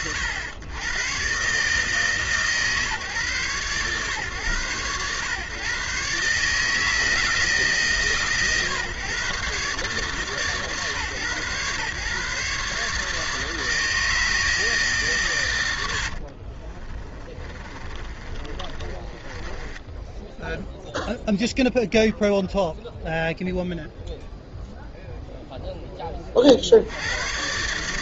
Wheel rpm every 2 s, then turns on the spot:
100, 140, 120, 160, 130, 140, 150, 160, 30, 30, 0, 0, 0, 50.
16-20